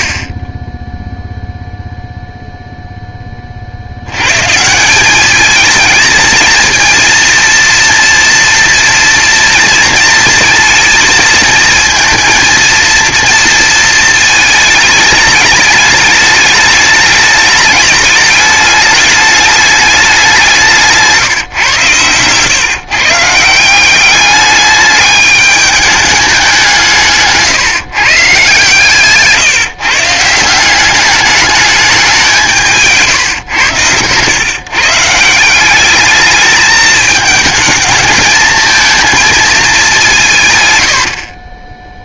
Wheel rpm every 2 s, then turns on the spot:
10, 0, 180, 230, 230, 230, 230, 220, 210, 210, 170, 140, 210, 170, 140, 190, 160, 150, 210, 220, 90.
40-42